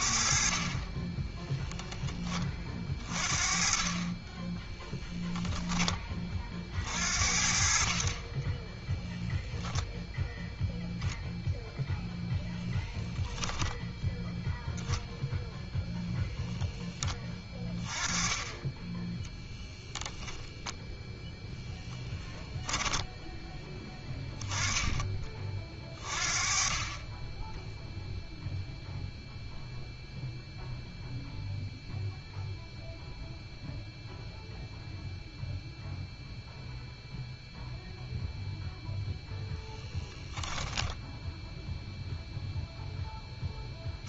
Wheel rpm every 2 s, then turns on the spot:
20, 30, 10, 50, 20, 0, 0, 10, 10, 10, 0, 10, 10, 20, 0, 0, 0, 0, 0, 0, 10, 0.
4-6 22-24 40-42